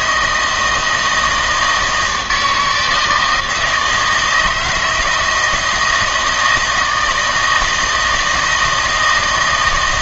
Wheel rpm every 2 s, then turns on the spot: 160, 160, 160, 160, 160.
none